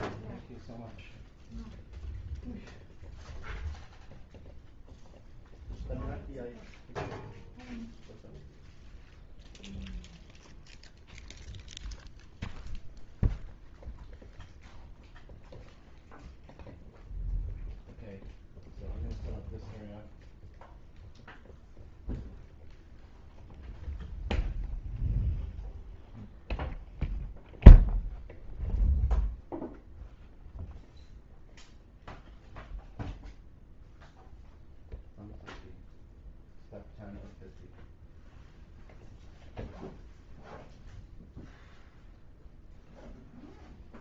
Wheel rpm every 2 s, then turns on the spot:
0, 0, 0, 0, 0, 0, 0, 0, 0, 0, 0, 0, 0, 0, 0, 0, 0, 0, 0, 0, 0, 0.
none